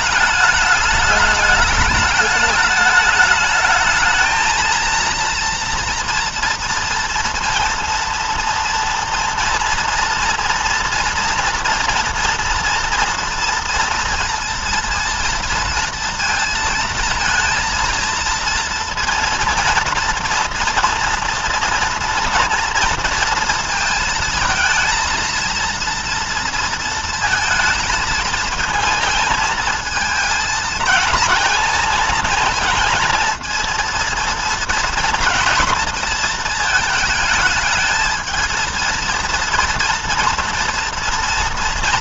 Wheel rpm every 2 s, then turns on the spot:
210, 210, 220, 230, 230, 230, 230, 230, 230, 230, 230, 230, 220, 230, 230, 220, 220, 230, 220, 220, 230.
none